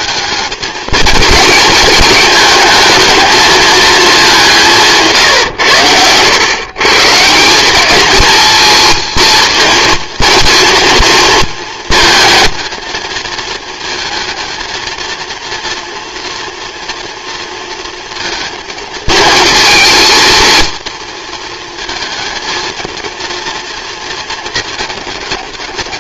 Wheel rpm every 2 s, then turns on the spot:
220, 220, 190, 120, 220, 230, 220, 230, 230, 220, 230, 230, 230.
none